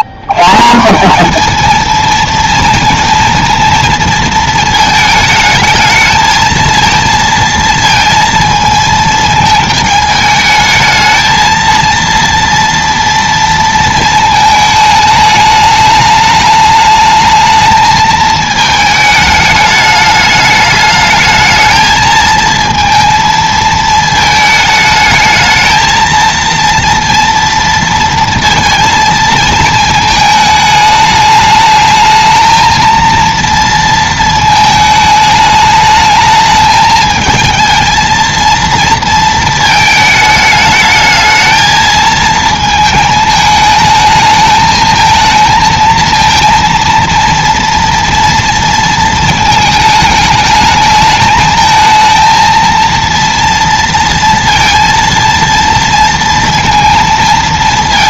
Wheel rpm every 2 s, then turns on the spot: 150, 230, 220, 230, 220, 220, 230, 220, 210, 220, 210, 220, 220, 230, 230, 210, 220, 220, 220, 230, 220, 220, 220, 230, 230, 220, 230, 230, 230.
none